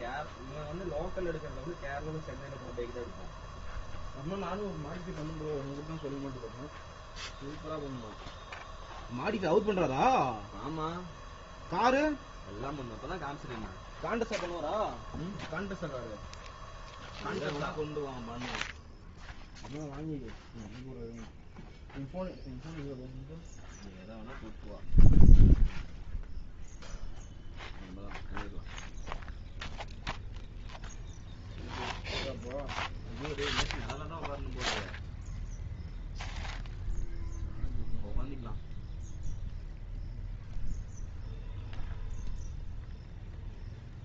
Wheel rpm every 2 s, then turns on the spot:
0, 0, 0, 0, 0, 0, 0, 0, 0, 0, 0, 0, 0, 0, 0, 0, 0, 0, 0, 0, 0, 0.
none